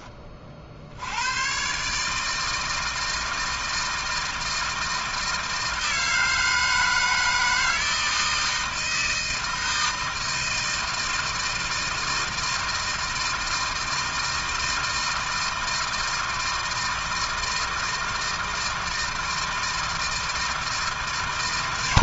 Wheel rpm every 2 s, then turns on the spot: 80, 160, 160, 160, 160, 160, 160, 160, 160, 160, 160.
none